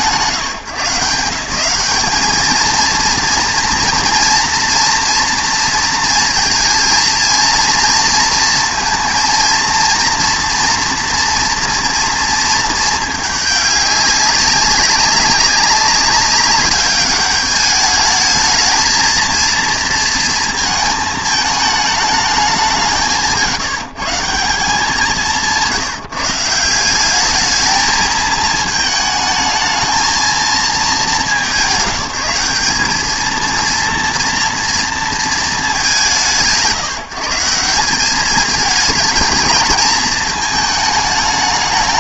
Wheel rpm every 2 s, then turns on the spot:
140, 220, 230, 220, 230, 230, 220, 200, 200, 220, 220, 200, 160, 180, 220, 210, 180, 230, 140, 210, 220.
none